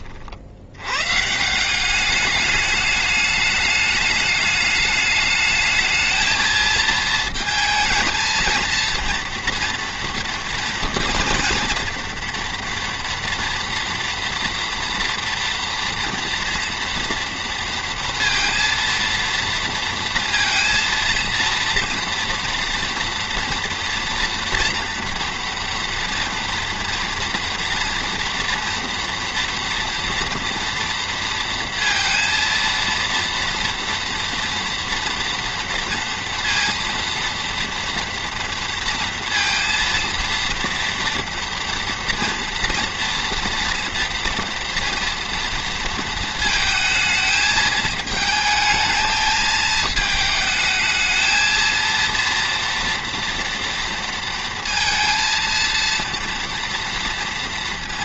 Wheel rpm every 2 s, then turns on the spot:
150, 210, 210, 220, 240, 230, 230, 240, 230, 230, 230, 230, 230, 240, 230, 230, 230, 230, 230, 230, 230, 230, 230, 220, 220, 220, 230, 230, 230.
none